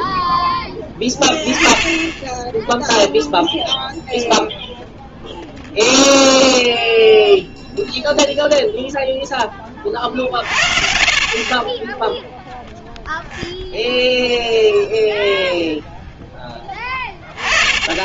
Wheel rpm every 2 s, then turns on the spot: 0, 0, 0, 0, 0, 50, 0, 0, 10.
10-12